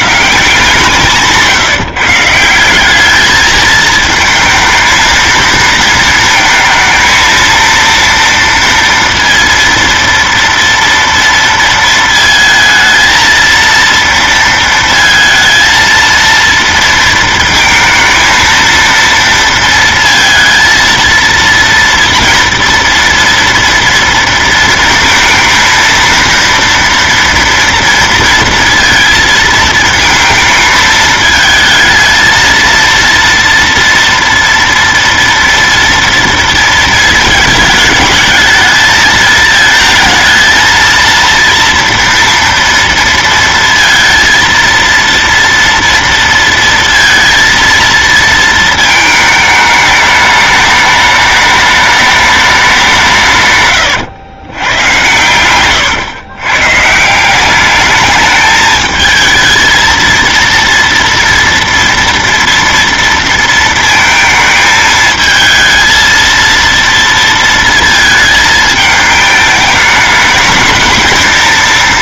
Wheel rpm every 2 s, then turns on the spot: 160, 170, 220, 220, 230, 230, 220, 230, 230, 230, 230, 230, 230, 230, 230, 220, 230, 230, 230, 220, 230, 230, 230, 230, 220, 210, 200, 110, 130, 210, 230, 230, 220, 230, 220, 220.
none